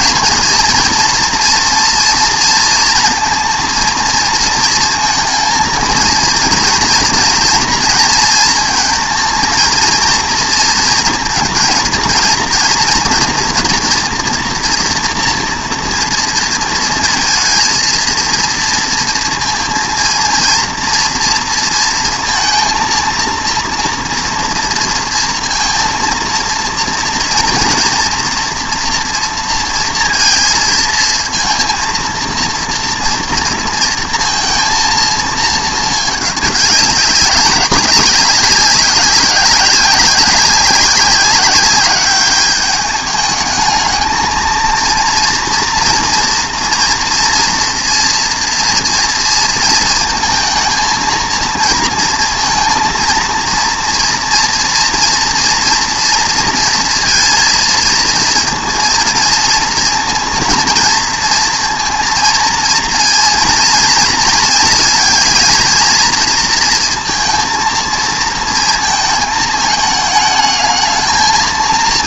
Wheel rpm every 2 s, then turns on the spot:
230, 230, 230, 230, 220, 230, 230, 240, 230, 230, 230, 230, 230, 230, 230, 230, 230, 230, 200, 200, 190, 210, 230, 230, 230, 220, 230, 230, 230, 230, 230, 230, 230, 230, 230, 220.
none